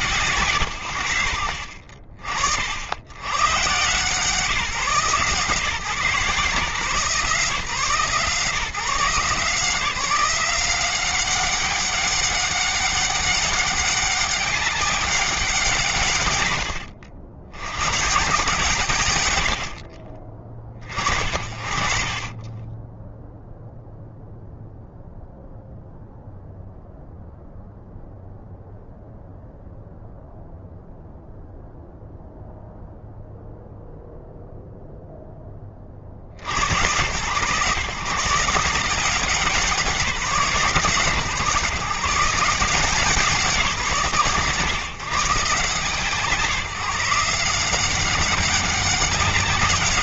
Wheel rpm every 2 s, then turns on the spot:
140, 60, 140, 140, 150, 170, 200, 200, 150, 120, 60, 30, 0, 0, 0, 0, 0, 10, 120, 180, 140, 160, 150, 180, 200.
none